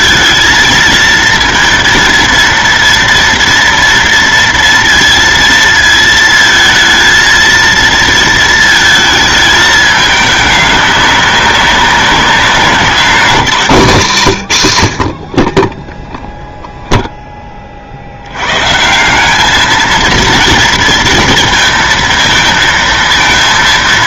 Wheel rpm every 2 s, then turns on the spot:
220, 230, 230, 230, 230, 210, 200, 130, 0, 110, 230, 230.
none